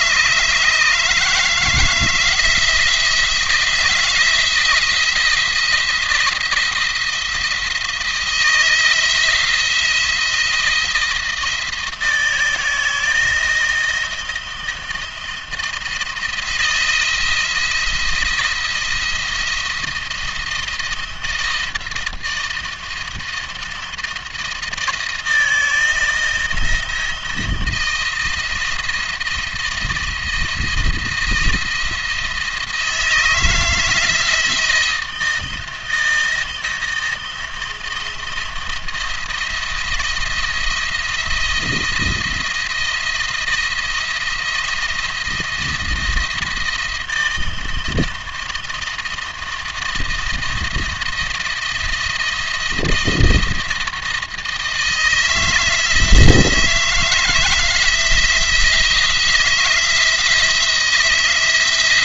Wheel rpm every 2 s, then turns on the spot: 150, 160, 170, 170, 160, 170, 160, 160, 170, 170, 170, 160, 160, 160, 170, 160, 160, 160, 160, 170, 170, 170, 170, 170, 170, 170, 170, 160, 160, 160, 170.
none